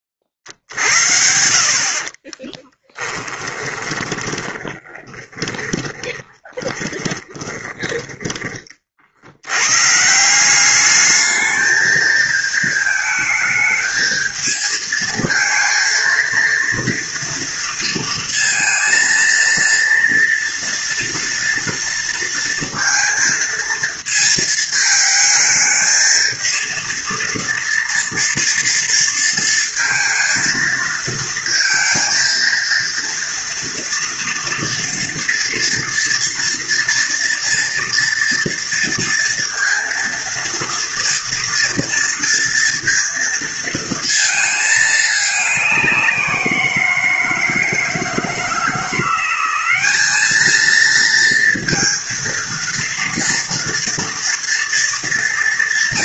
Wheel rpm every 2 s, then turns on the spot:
40, 20, 20, 20, 30, 190, 220, 220, 230, 230, 230, 230, 220, 230, 230, 220, 230, 230, 230, 230, 230, 230, 220, 170, 160, 220, 230, 230.
2-8